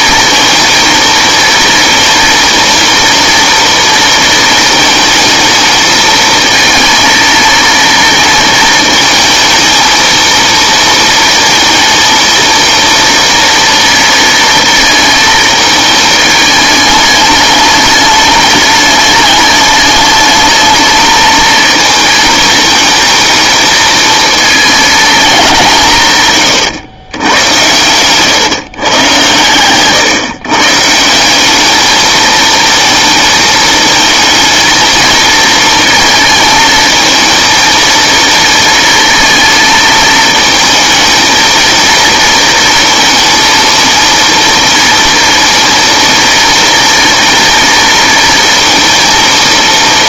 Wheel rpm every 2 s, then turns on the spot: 230, 230, 220, 230, 230, 230, 230, 230, 210, 210, 210, 220, 220, 130, 130, 140, 230, 220, 220, 230, 220, 230, 230, 230, 230.
none